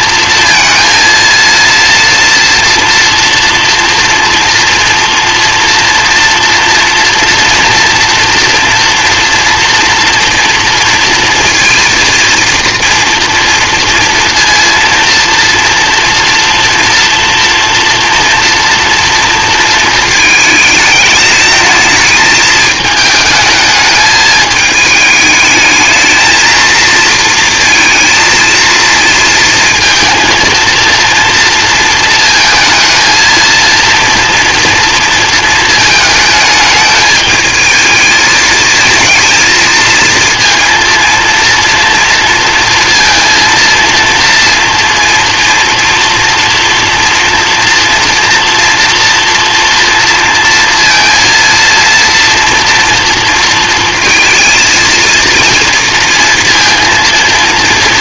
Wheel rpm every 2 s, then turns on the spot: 230, 230, 230, 230, 230, 230, 240, 230, 230, 230, 210, 210, 220, 230, 230, 230, 220, 230, 220, 220, 230, 230, 230, 240, 240, 230, 240, 230, 230.
none